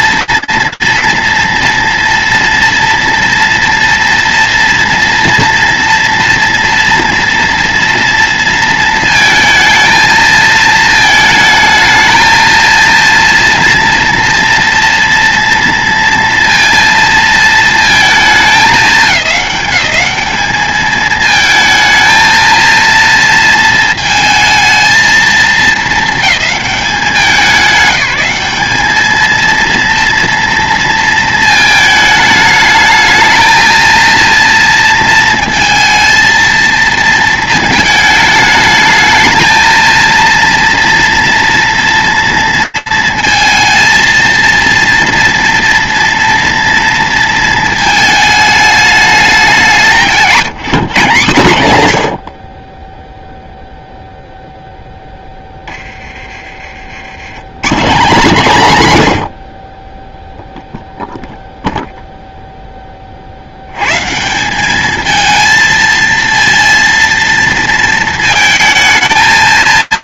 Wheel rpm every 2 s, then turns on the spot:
230, 230, 240, 230, 230, 220, 230, 230, 230, 200, 210, 230, 220, 210, 210, 230, 210, 230, 230, 220, 230, 230, 230, 230, 210, 170, 20, 10, 110, 90, 0, 70, 220, 230, 220.
none